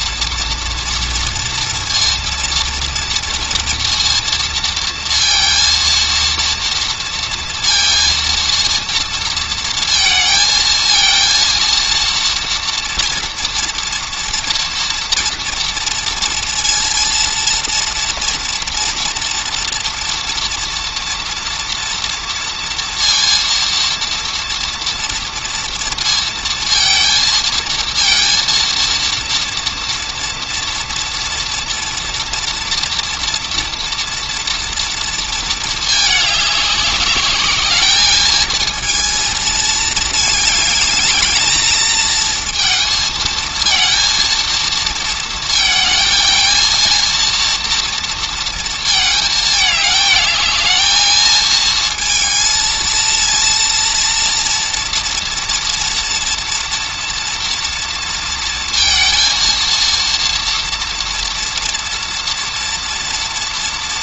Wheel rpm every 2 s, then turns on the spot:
230, 230, 230, 230, 230, 230, 230, 230, 230, 230, 230, 230, 230, 230, 230, 230, 230, 230, 210, 220, 220, 220, 230, 230, 220, 220, 230, 230, 230, 230, 230, 230.
none